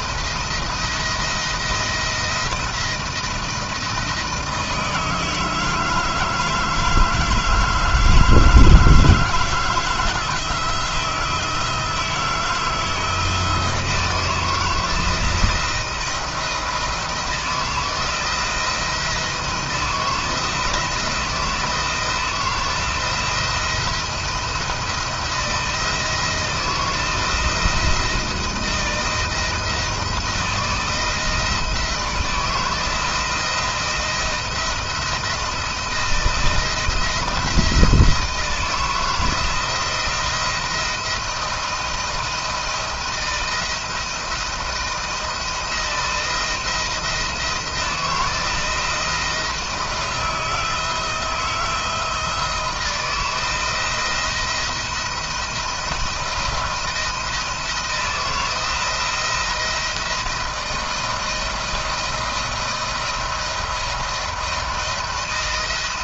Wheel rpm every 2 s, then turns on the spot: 160, 170, 160, 160, 160, 160, 160, 160, 170, 160, 160, 170, 170, 160, 170, 160, 170, 170, 160, 170, 170, 160, 160, 170, 170, 160, 160, 170, 170, 170, 170, 170, 170.
none